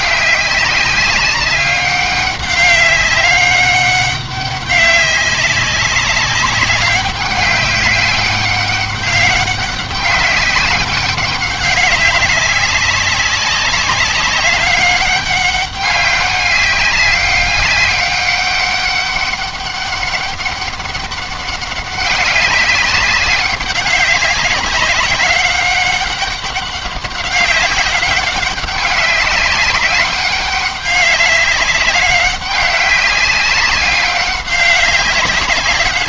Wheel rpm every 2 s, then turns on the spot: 190, 200, 200, 200, 200, 190, 200, 200, 200, 200, 200, 200, 200, 200, 200, 200, 200, 200.
none